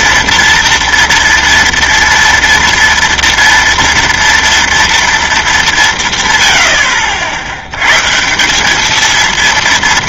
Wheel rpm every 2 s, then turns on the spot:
230, 230, 230, 100, 190.
none